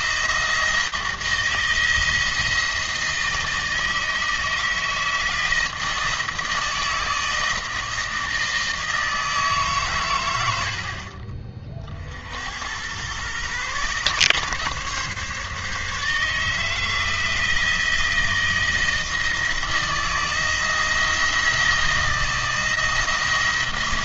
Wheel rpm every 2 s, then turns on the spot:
170, 170, 160, 160, 160, 60, 110, 140, 160, 160, 170, 170.
10-12